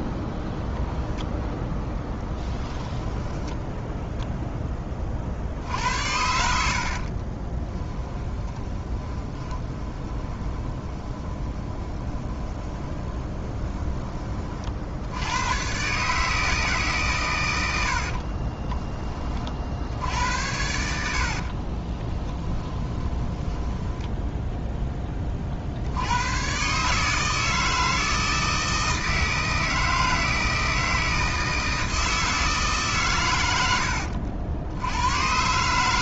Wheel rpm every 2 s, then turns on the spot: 0, 10, 10, 70, 20, 20, 20, 40, 150, 30, 80, 20, 10, 130, 160, 160, 150, 90.
6-14 18-24